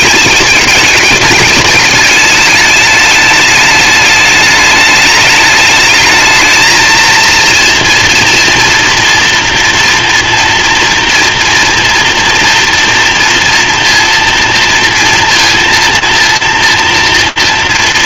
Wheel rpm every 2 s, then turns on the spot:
210, 210, 210, 220, 230, 230, 230, 230, 230.
none